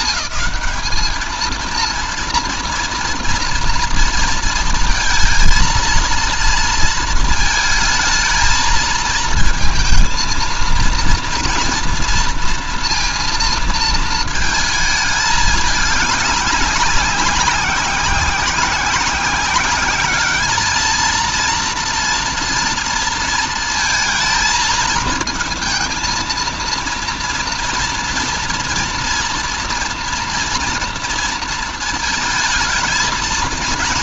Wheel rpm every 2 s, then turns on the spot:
210, 230, 230, 230, 220, 230, 230, 220, 200, 190, 220, 230, 220, 230, 240, 230, 220.
none